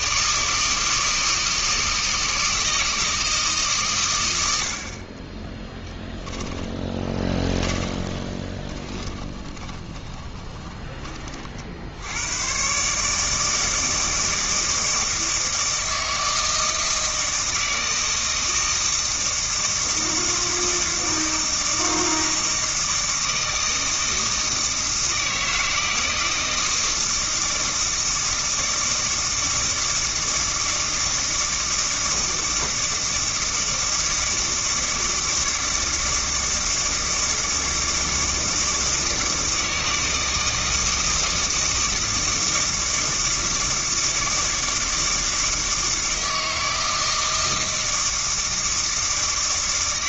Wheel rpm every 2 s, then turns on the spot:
160, 160, 50, 20, 20, 20, 140, 160, 160, 160, 160, 160, 160, 160, 160, 160, 160, 160, 160, 160, 160, 160, 160, 160, 160.
6-10